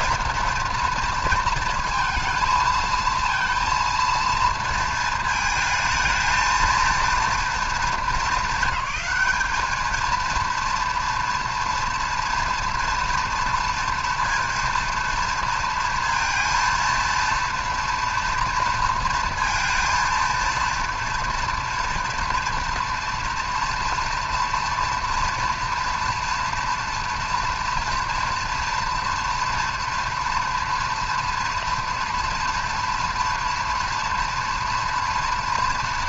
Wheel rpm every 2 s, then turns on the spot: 230, 220, 230, 230, 200, 230, 240, 230, 230, 230, 230, 230, 230, 230, 230, 230, 230, 230.
none